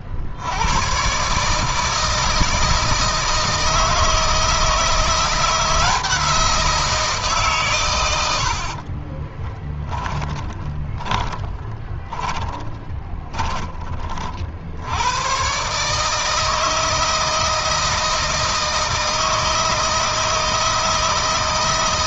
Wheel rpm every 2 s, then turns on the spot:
110, 160, 170, 170, 50, 20, 20, 80, 160, 160, 160.
8-14